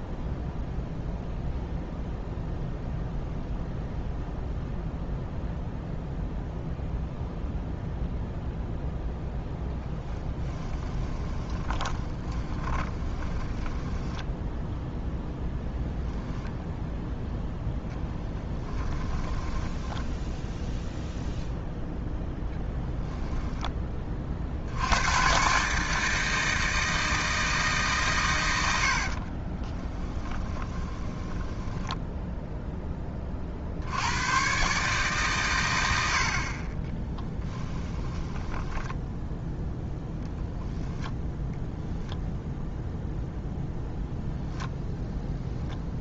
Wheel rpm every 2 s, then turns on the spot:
0, 0, 0, 0, 0, 20, 20, 0, 0, 10, 0, 10, 80, 160, 80, 20, 10, 130, 30, 10, 0, 0, 0.
10-14 18-20 28-32 38-40